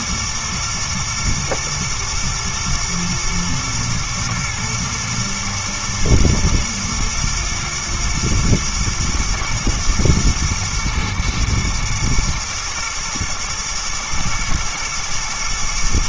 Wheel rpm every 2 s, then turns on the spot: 120, 120, 110, 110, 110, 120, 110, 110.
none